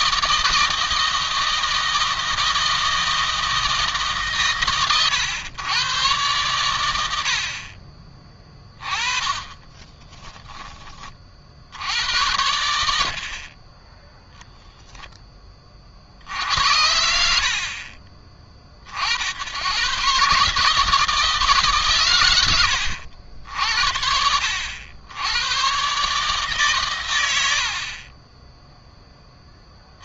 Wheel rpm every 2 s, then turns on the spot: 160, 160, 130, 110, 20, 20, 80, 0, 70, 50, 150, 90, 70, 140, 20.
8-12